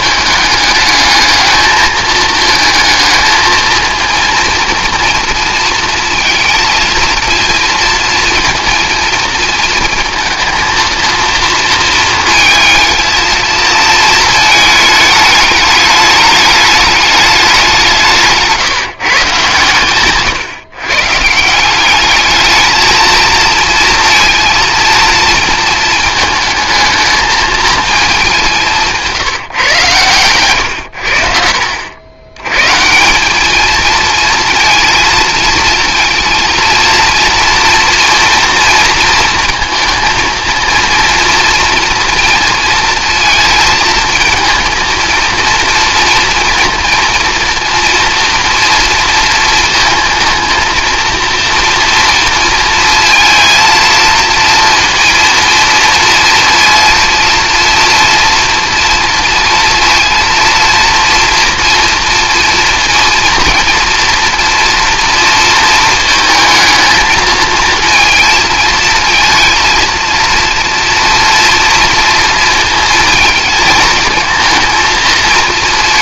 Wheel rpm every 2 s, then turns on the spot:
210, 220, 230, 220, 230, 230, 230, 220, 210, 160, 130, 220, 230, 220, 170, 100, 140, 230, 230, 230, 230, 230, 230, 230, 230, 230, 230, 230, 230, 230, 230, 230, 230, 220, 230, 230, 230, 230.
none